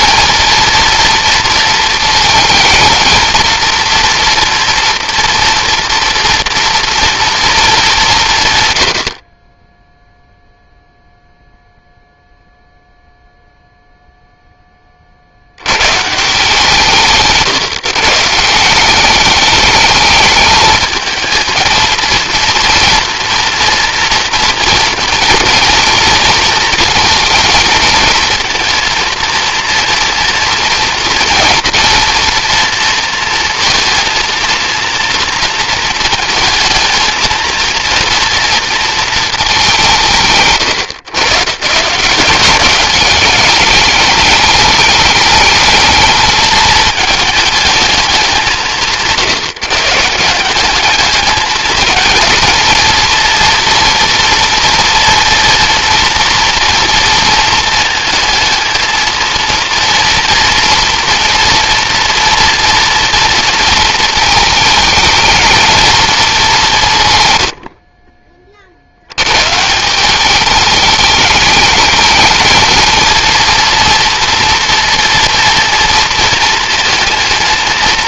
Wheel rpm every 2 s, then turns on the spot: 230, 230, 230, 230, 110, 0, 0, 20, 170, 180, 220, 230, 230, 220, 230, 230, 230, 230, 220, 230, 110, 200, 210, 210, 160, 200, 230, 230, 240, 230, 240, 240, 220, 180, 70, 220, 220, 230, 230.
none